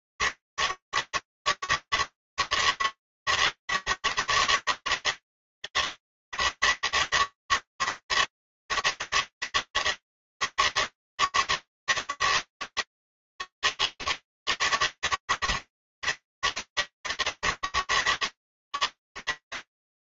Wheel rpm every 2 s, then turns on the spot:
140, 140, 150, 150, 160, 160, 160, 160, 140, 150.
none